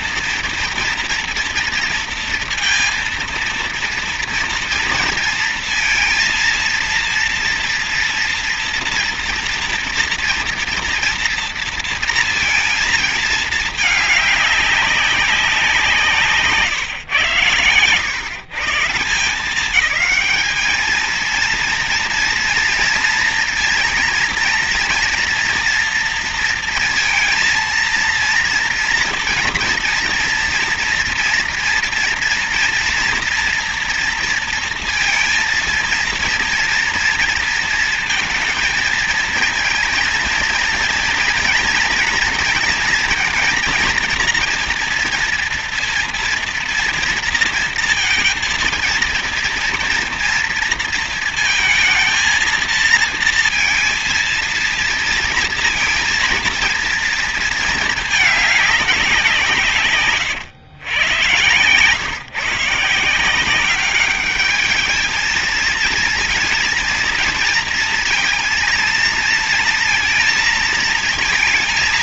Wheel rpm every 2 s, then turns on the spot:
230, 230, 230, 230, 230, 230, 220, 200, 140, 170, 220, 240, 230, 230, 230, 230, 230, 230, 230, 220, 230, 230, 230, 230, 230, 230, 220, 230, 220, 200, 120, 160, 210, 230, 230, 230.
none